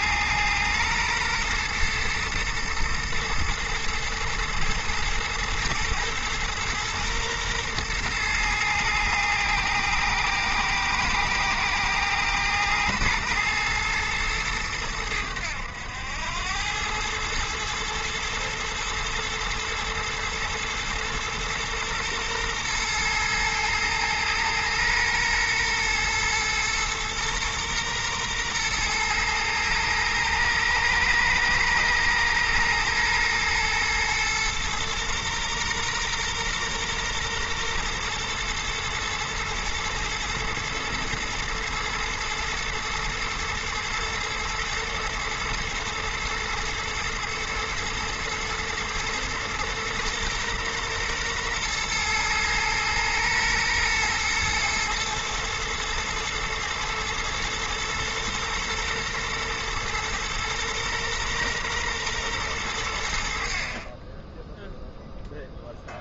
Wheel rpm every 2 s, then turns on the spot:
120, 110, 110, 120, 110, 110, 110, 110, 100, 110, 120, 120, 120, 120, 120, 110, 110, 120, 120, 120, 120, 110, 120, 110, 120, 120, 120, 120, 110, 120, 120, 110, 10.
none